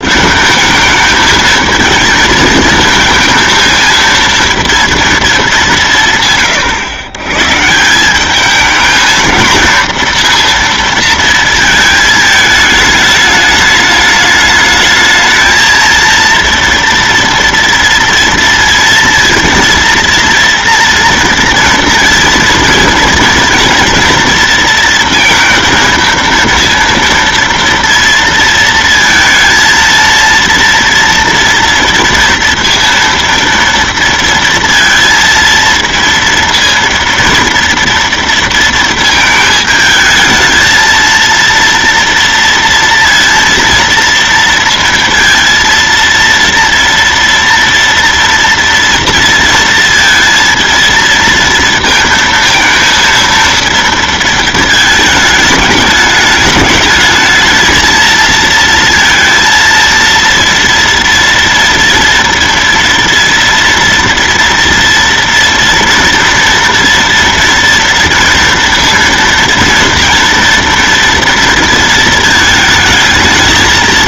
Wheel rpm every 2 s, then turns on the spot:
220, 220, 230, 130, 220, 230, 210, 210, 230, 230, 230, 230, 230, 230, 230, 230, 230, 230, 230, 230, 220, 230, 230, 230, 230, 230, 230, 220, 210, 230, 230, 230, 230, 230, 230, 230, 220.
none